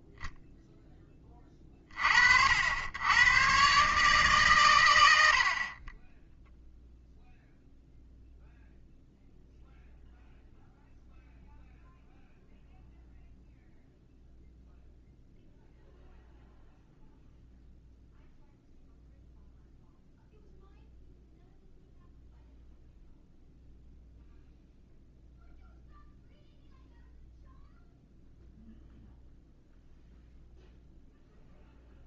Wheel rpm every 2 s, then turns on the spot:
0, 80, 120, 0, 0, 0, 0, 0, 0, 0, 0, 0, 0, 0, 0, 0.
none